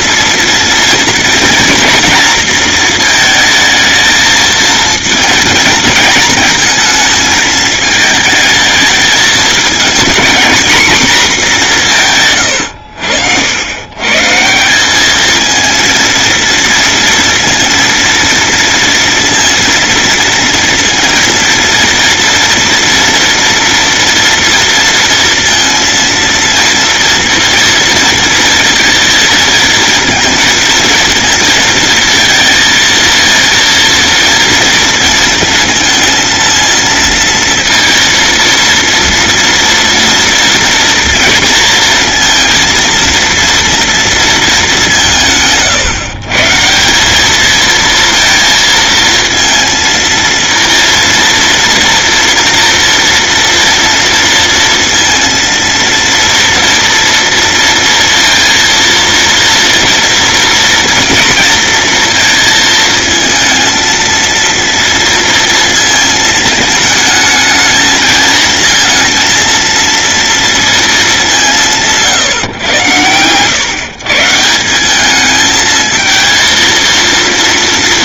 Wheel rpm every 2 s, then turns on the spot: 230, 220, 220, 220, 220, 230, 80, 210, 230, 230, 230, 230, 230, 230, 230, 230, 230, 230, 230, 230, 230, 230, 160, 200, 230, 230, 240, 230, 230, 230, 230, 220, 230, 220, 230, 200, 100, 210, 230.
none